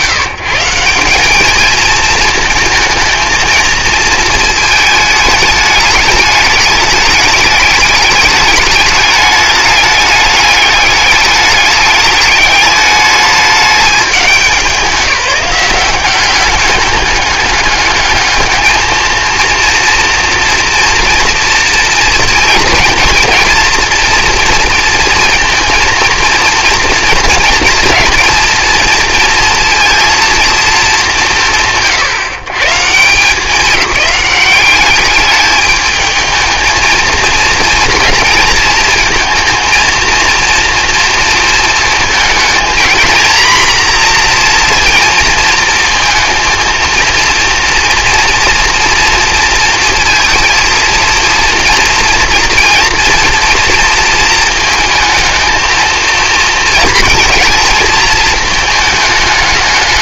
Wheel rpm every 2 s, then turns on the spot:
170, 220, 220, 210, 210, 210, 210, 190, 200, 220, 230, 230, 230, 230, 230, 220, 140, 200, 220, 230, 230, 230, 240, 230, 230, 230, 240, 230, 230, 220.
none